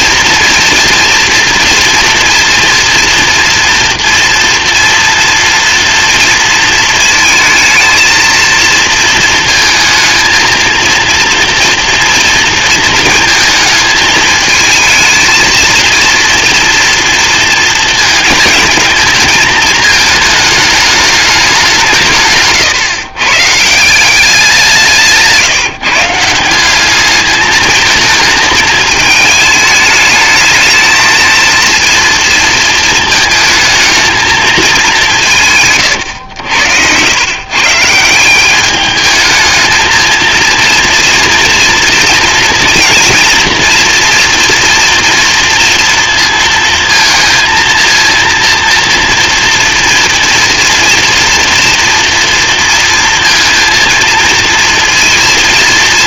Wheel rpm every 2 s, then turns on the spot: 230, 230, 230, 230, 230, 220, 230, 220, 240, 220, 210, 140, 180, 180, 220, 220, 230, 220, 110, 200, 230, 230, 230, 230, 230, 230, 230, 230.
36-38